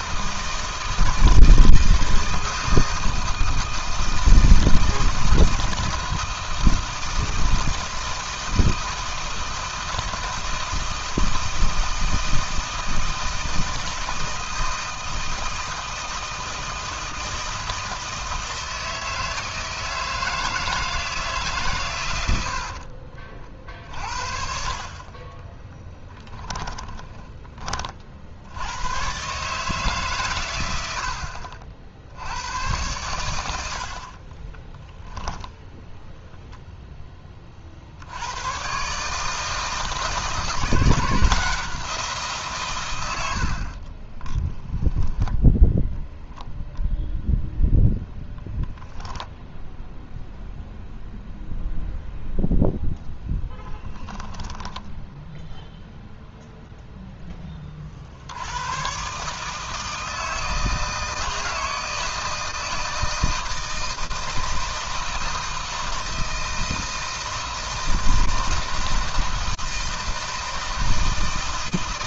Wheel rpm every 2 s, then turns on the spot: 160, 160, 160, 160, 160, 160, 160, 160, 160, 160, 160, 50, 40, 10, 100, 100, 100, 10, 0, 130, 160, 130, 20, 0, 0, 0, 0, 10, 0, 110, 160, 160, 160, 160, 160, 160.
22-24 26-28 34-36 44-46 54-56